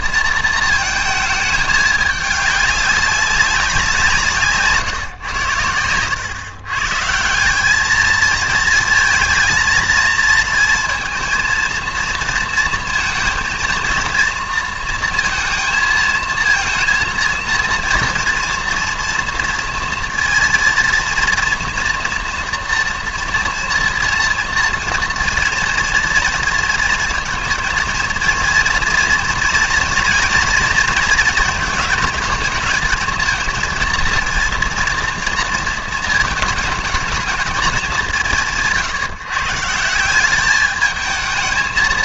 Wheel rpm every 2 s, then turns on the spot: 230, 200, 150, 120, 230, 230, 230, 230, 230, 230, 230, 230, 230, 230, 230, 230, 230, 230, 220, 160, 210.
none